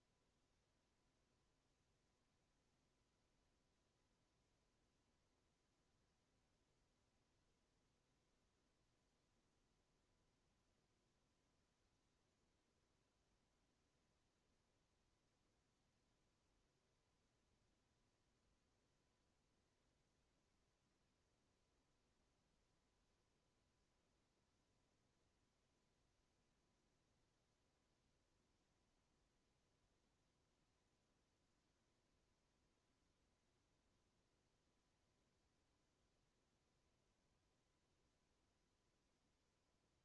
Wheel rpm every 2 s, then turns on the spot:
0, 0, 0, 0, 0, 0, 0, 0, 0, 0, 0, 0, 0, 0, 0, 0, 0, 0, 0, 0.
none